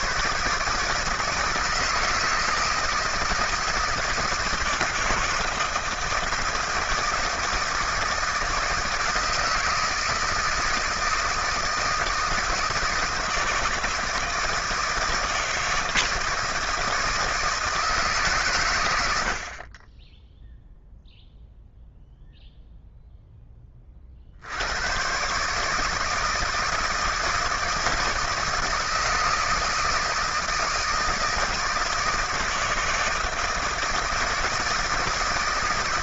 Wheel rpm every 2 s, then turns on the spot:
150, 160, 160, 160, 160, 160, 160, 160, 160, 110, 0, 0, 80, 160, 160, 160, 160, 160.
none